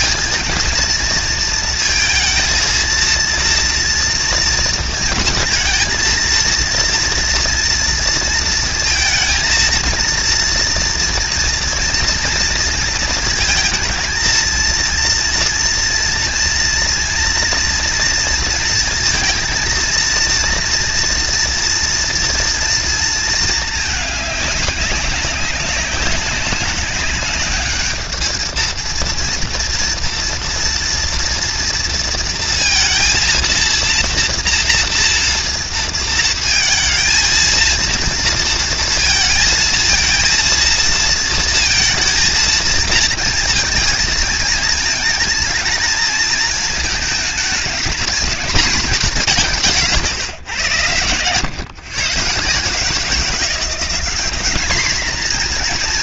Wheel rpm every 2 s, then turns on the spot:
230, 230, 230, 230, 230, 230, 230, 230, 230, 230, 230, 230, 210, 200, 230, 230, 230, 230, 230, 230, 230, 230, 220, 220, 220, 120, 160, 210.
none